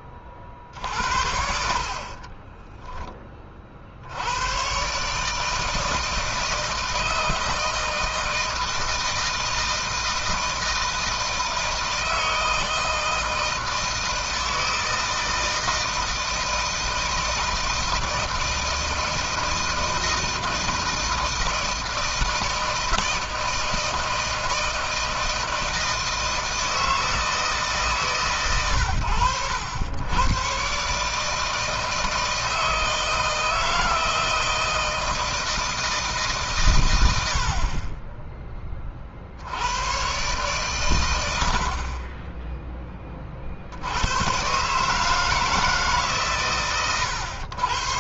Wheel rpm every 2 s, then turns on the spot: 50, 30, 110, 160, 160, 160, 160, 160, 160, 160, 160, 160, 160, 160, 120, 130, 160, 160, 140, 30, 130, 20, 120, 130.
2-4